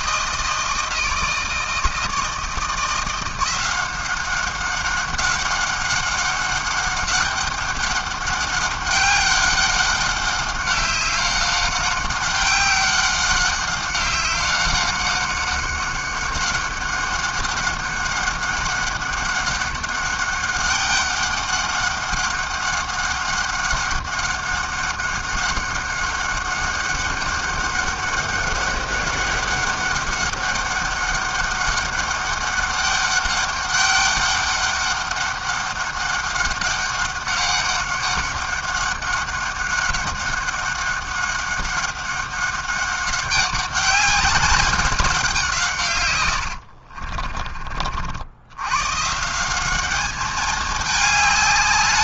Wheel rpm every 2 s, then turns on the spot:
160, 170, 190, 190, 190, 190, 190, 190, 190, 190, 200, 190, 200, 200, 200, 200, 200, 200, 200, 200, 200, 190, 200, 60, 110, 220.
46-48